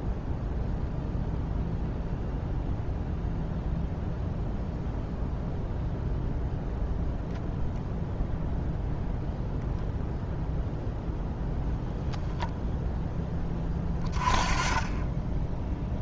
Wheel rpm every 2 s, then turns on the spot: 0, 0, 0, 0, 0, 0, 0, 20.
none